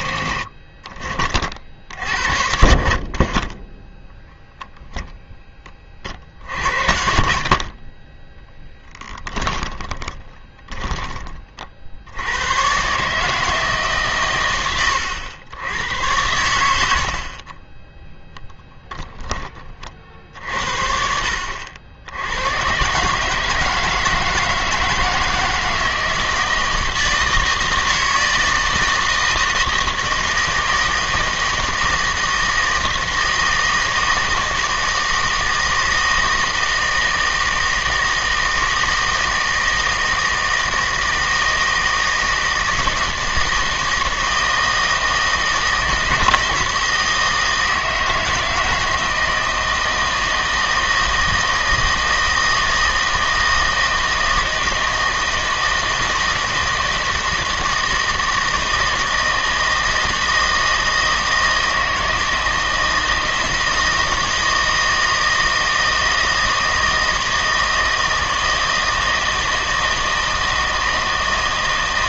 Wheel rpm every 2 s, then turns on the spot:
40, 50, 0, 50, 10, 20, 120, 90, 80, 10, 60, 110, 160, 160, 160, 160, 160, 160, 160, 160, 160, 160, 160, 170, 160, 160, 160, 160, 160, 160, 160, 160, 160, 160, 160, 160.
8-12